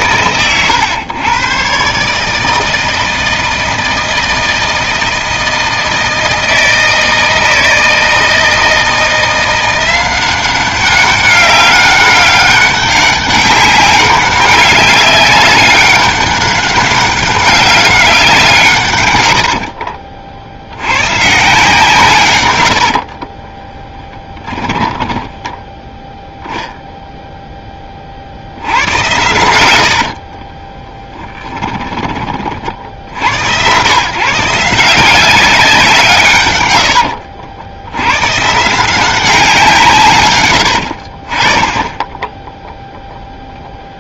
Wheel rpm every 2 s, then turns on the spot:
120, 160, 160, 160, 160, 190, 200, 200, 190, 120, 110, 60, 10, 0, 80, 20, 60, 170, 80, 180, 70, 0.
18-20 22-26 30-32 36-38